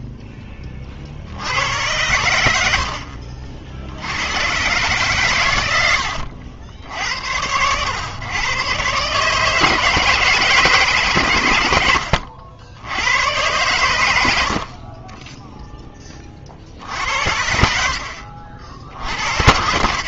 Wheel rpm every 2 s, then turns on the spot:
20, 60, 130, 80, 120, 150, 70, 60, 60, 70.
none